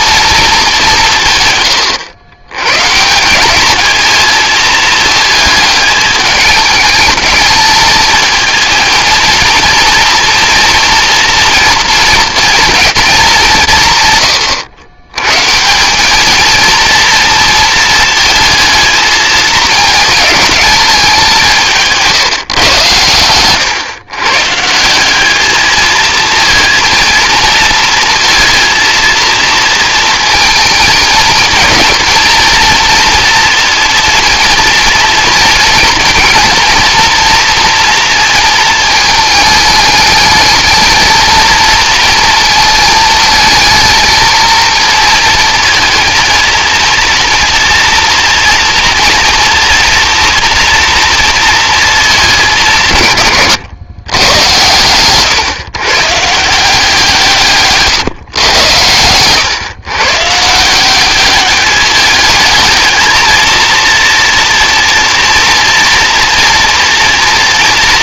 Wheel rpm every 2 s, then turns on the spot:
180, 140, 220, 220, 230, 230, 230, 120, 230, 220, 200, 110, 170, 230, 230, 230, 230, 230, 230, 220, 220, 220, 230, 230, 230, 230, 160, 120, 170, 110, 180, 220, 230, 230.
none